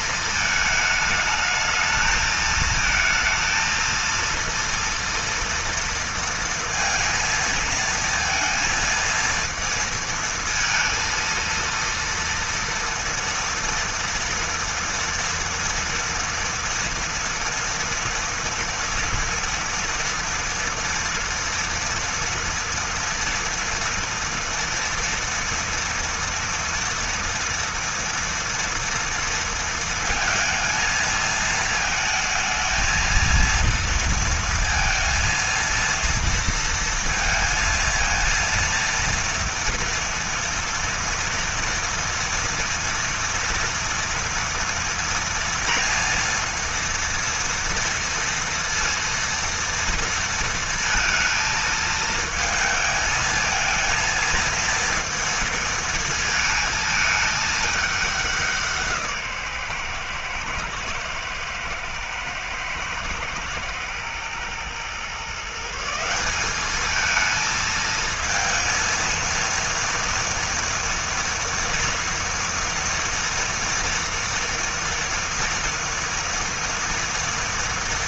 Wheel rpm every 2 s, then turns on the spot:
220, 220, 230, 230, 230, 230, 230, 230, 230, 230, 230, 230, 230, 230, 230, 220, 220, 230, 230, 230, 230, 230, 230, 230, 230, 230, 220, 230, 220, 160, 110, 110, 130, 210, 230, 230, 230, 230, 230.
none